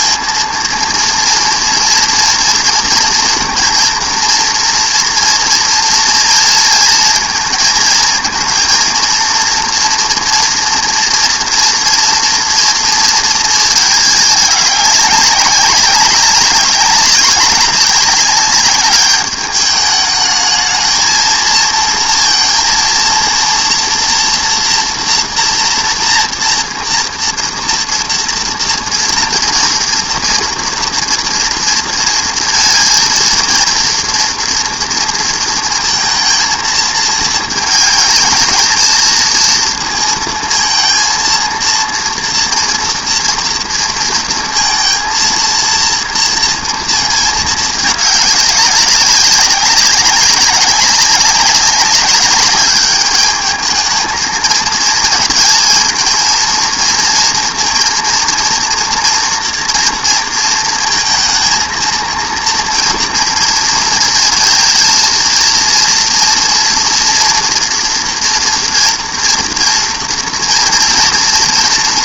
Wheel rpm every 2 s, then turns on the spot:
230, 230, 230, 230, 230, 240, 240, 200, 200, 200, 220, 230, 240, 240, 230, 230, 230, 230, 220, 220, 230, 230, 230, 230, 200, 200, 200, 220, 230, 230, 220, 230, 230, 230, 230, 230.
none